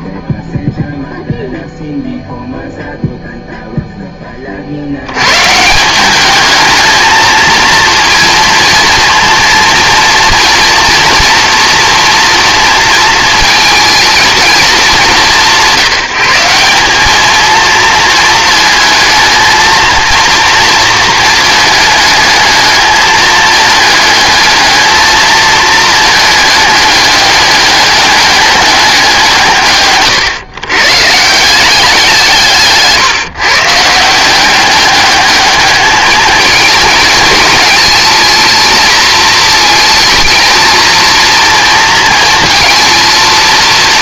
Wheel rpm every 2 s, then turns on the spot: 0, 0, 60, 220, 230, 240, 230, 210, 190, 220, 230, 220, 220, 210, 200, 120, 150, 200, 220, 220, 230, 230.
none